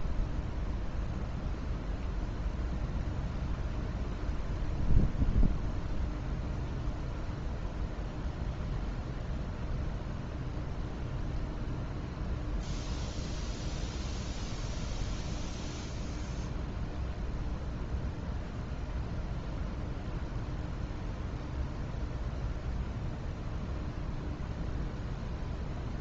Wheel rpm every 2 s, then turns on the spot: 0, 0, 0, 0, 0, 0, 0, 0, 0, 0, 0, 0, 0.
none